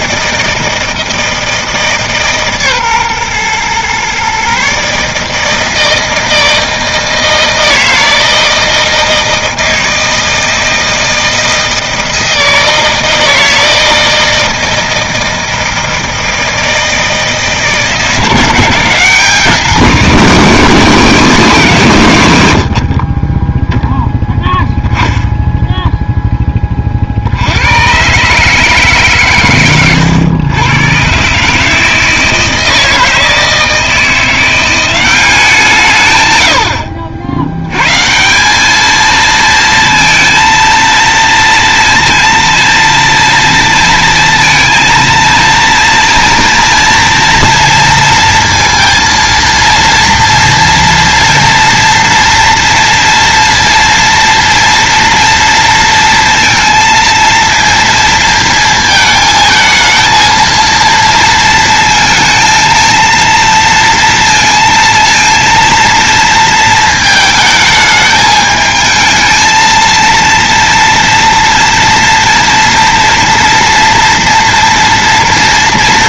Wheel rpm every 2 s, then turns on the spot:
160, 140, 150, 160, 160, 160, 160, 160, 160, 180, 200, 50, 10, 20, 140, 120, 160, 190, 70, 220, 230, 230, 230, 230, 230, 230, 230, 230, 230, 220, 230, 230, 230, 220, 220, 230, 230, 230.
none